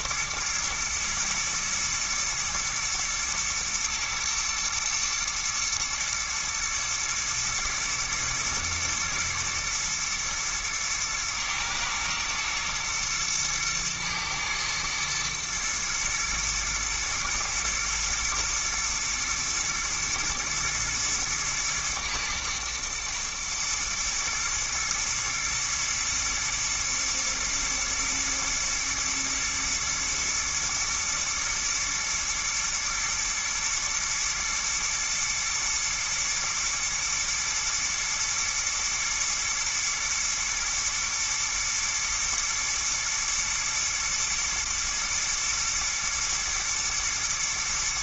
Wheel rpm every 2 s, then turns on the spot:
120, 110, 120, 110, 110, 120, 110, 110, 110, 120, 120, 110, 120, 110, 110, 120, 120, 110, 120, 110, 120, 110, 110, 120.
none